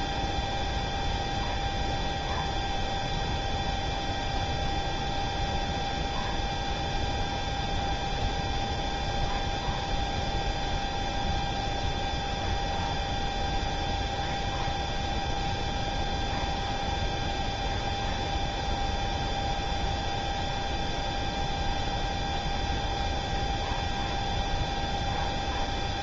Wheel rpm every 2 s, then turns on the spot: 0, 0, 0, 0, 0, 0, 0, 0, 0, 0, 0, 0, 0.
none